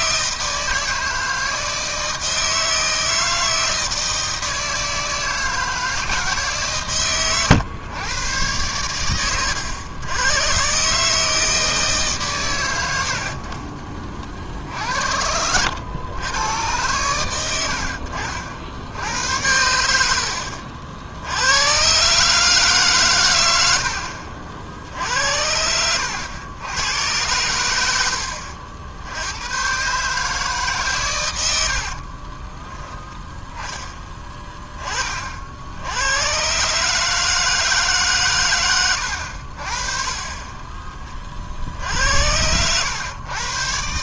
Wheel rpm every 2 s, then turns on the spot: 160, 160, 160, 130, 100, 140, 90, 60, 110, 80, 60, 140, 60, 100, 70, 130, 10, 20, 140, 110, 20, 90.
none